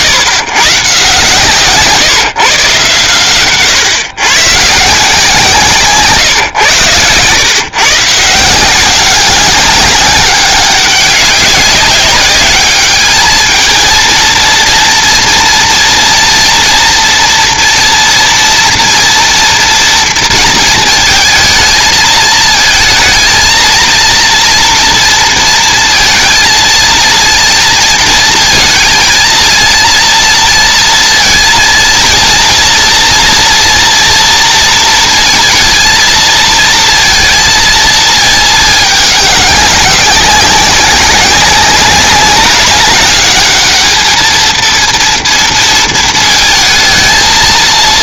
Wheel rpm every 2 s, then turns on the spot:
120, 130, 150, 120, 180, 200, 210, 230, 240, 230, 230, 220, 230, 230, 220, 230, 230, 230, 230, 210, 190, 200, 230, 220.
none